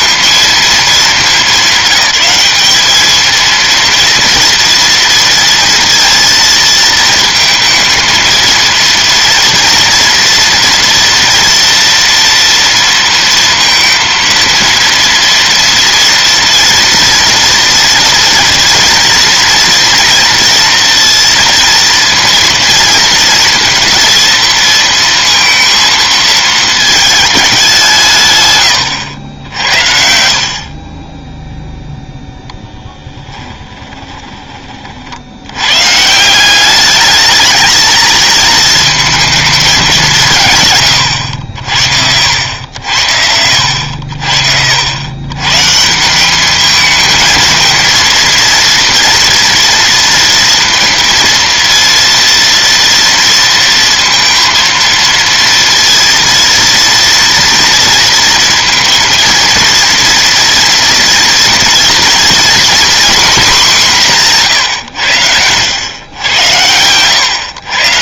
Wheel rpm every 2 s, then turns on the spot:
220, 210, 230, 220, 230, 240, 230, 230, 230, 240, 230, 230, 230, 220, 100, 30, 10, 40, 200, 220, 110, 80, 80, 210, 230, 230, 230, 230, 230, 230, 230, 240, 120, 90.
32-34 64-66